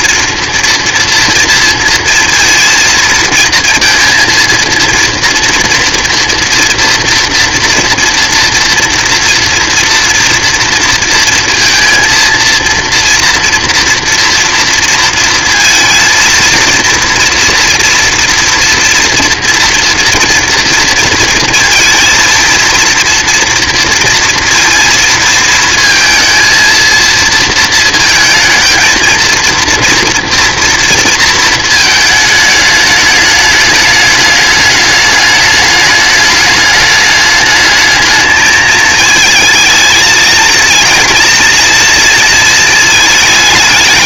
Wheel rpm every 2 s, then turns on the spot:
230, 230, 230, 240, 230, 230, 230, 230, 230, 230, 230, 230, 230, 230, 230, 230, 210, 210, 210, 220, 230, 220.
none